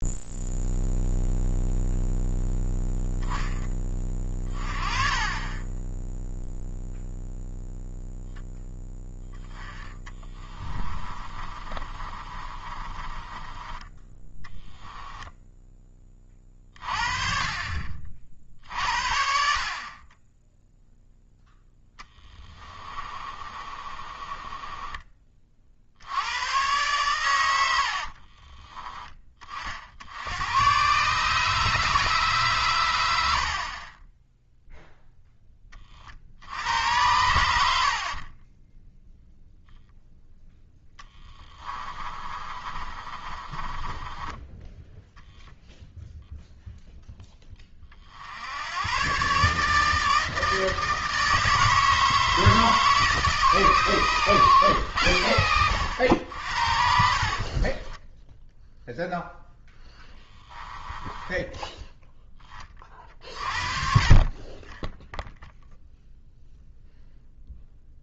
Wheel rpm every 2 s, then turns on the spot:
0, 0, 30, 0, 10, 20, 30, 10, 30, 50, 0, 30, 20, 120, 30, 120, 110, 0, 90, 10, 10, 30, 10, 0, 100, 160, 160, 120, 60, 0, 10, 30, 10, 0.
10-16 22-26 38-40 42-44 60-62